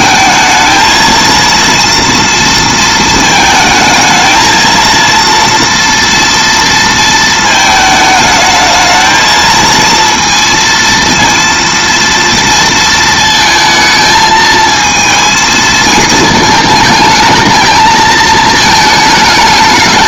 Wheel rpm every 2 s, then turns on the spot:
230, 230, 230, 230, 220, 230, 230, 220, 220, 220.
none